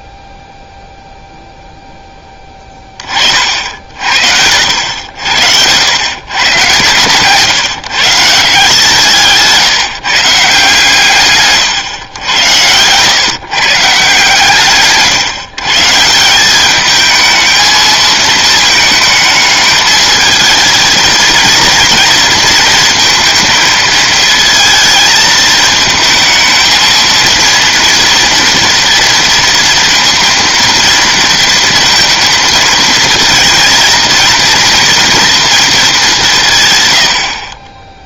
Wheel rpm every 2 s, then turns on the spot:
0, 20, 90, 130, 150, 140, 100, 150, 200, 220, 220, 230, 220, 230, 230, 230, 220, 240, 130.
none